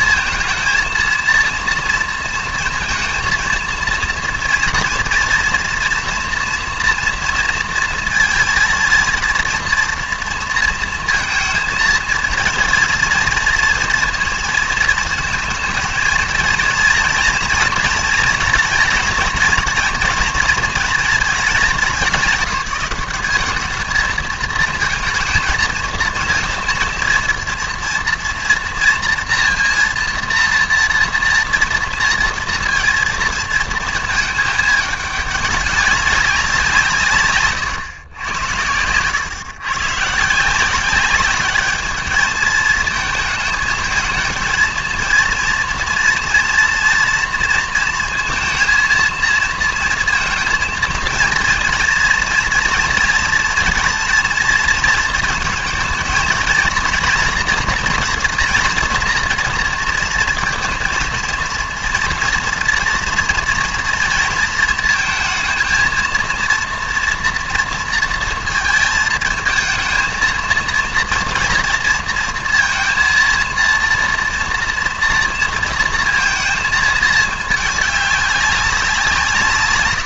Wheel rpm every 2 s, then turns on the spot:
230, 230, 230, 240, 230, 230, 230, 230, 230, 230, 230, 190, 230, 230, 230, 230, 230, 210, 180, 90, 170, 220, 230, 230, 230, 230, 240, 230, 230, 230, 230, 230, 230, 230, 220, 230, 230, 230, 220, 190.
38-40